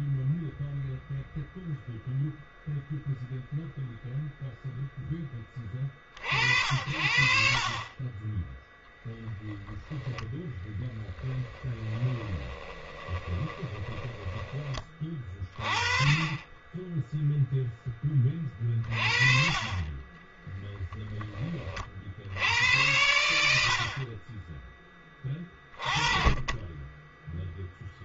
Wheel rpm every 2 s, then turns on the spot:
0, 0, 0, 70, 10, 10, 20, 20, 10, 40, 10, 90, 10, 20.
10-14